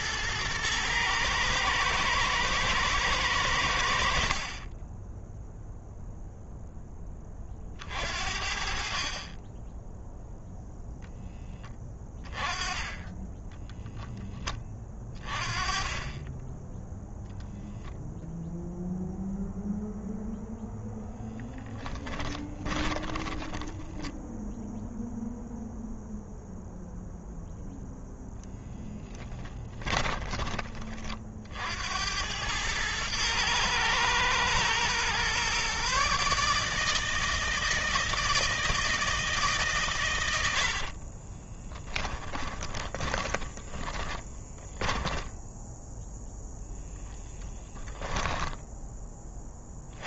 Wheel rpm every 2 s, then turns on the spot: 110, 110, 20, 10, 30, 0, 20, 20, 10, 0, 10, 20, 0, 0, 10, 30, 110, 120, 160, 160, 20, 20, 10, 0, 20.
22-24 28-30 40-46